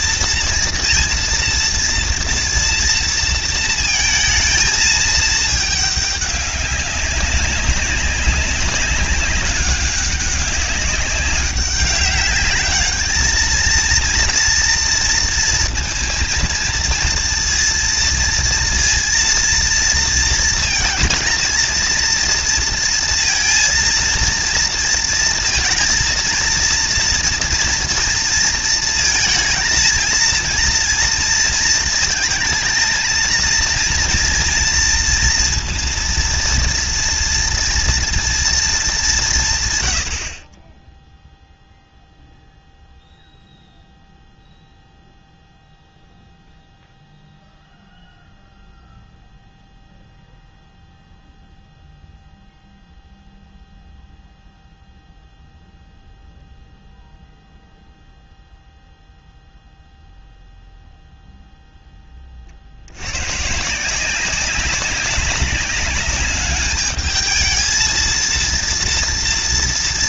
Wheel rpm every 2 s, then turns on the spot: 230, 230, 220, 200, 200, 190, 210, 230, 230, 230, 230, 230, 230, 230, 230, 230, 220, 230, 240, 220, 20, 0, 0, 0, 0, 0, 0, 0, 0, 0, 0, 70, 190, 210, 230.
none